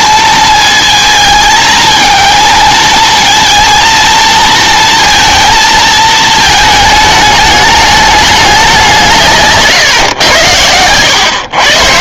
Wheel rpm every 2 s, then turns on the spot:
220, 220, 230, 220, 180, 100.
none